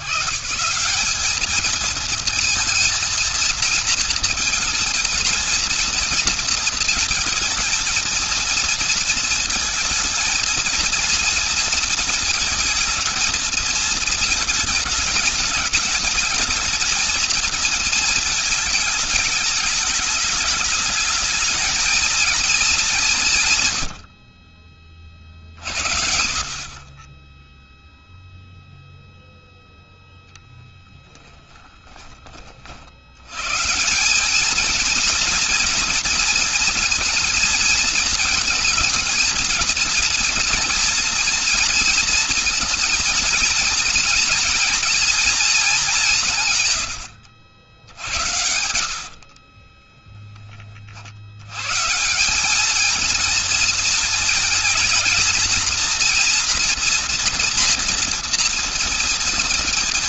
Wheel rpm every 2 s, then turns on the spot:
130, 230, 230, 230, 230, 230, 230, 220, 220, 220, 210, 210, 30, 40, 0, 10, 50, 210, 230, 220, 230, 230, 230, 120, 70, 30, 200, 230, 240, 230.
48-50